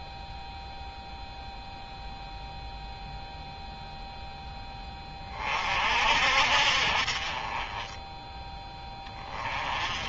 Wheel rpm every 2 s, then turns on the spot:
0, 0, 20, 50, 10.
none